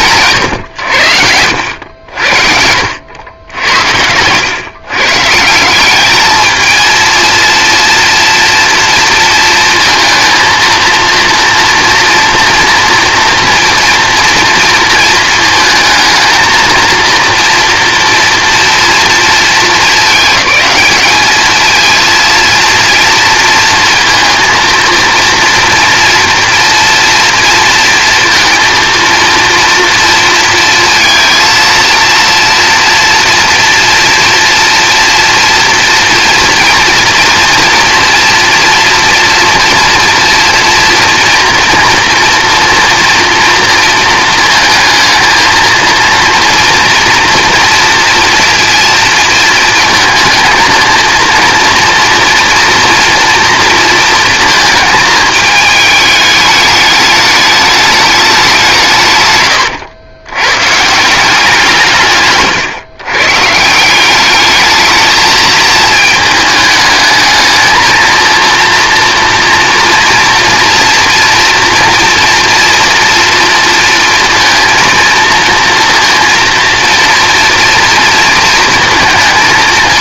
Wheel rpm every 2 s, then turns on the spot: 120, 70, 120, 220, 230, 230, 230, 230, 230, 230, 210, 230, 230, 230, 230, 230, 230, 230, 240, 230, 230, 230, 230, 230, 230, 230, 230, 230, 210, 190, 130, 130, 210, 220, 230, 230, 230, 230, 230, 230.
none